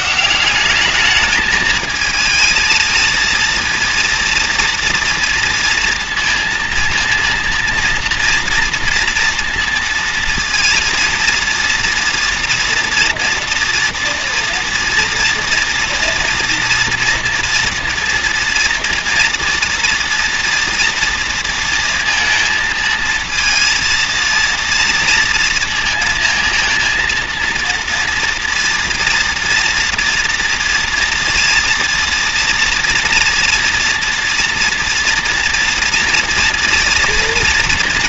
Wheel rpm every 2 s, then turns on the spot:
200, 220, 230, 230, 230, 230, 230, 240, 230, 230, 240, 230, 230, 230, 240, 230, 230, 230, 230.
none